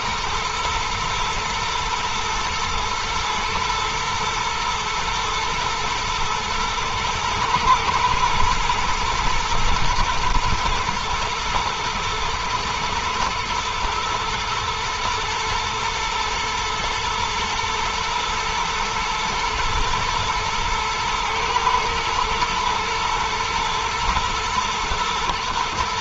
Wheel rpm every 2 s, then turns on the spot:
110, 120, 110, 110, 120, 110, 110, 120, 110, 120, 110, 110, 110.
none